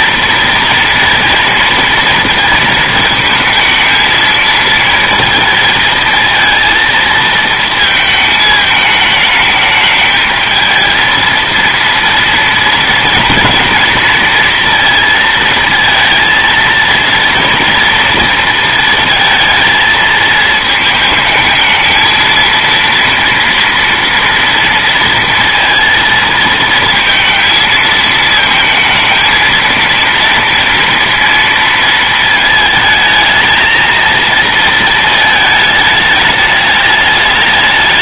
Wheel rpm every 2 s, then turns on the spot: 230, 220, 220, 230, 220, 220, 230, 230, 230, 230, 220, 230, 230, 230, 220, 230, 220, 220, 210.
none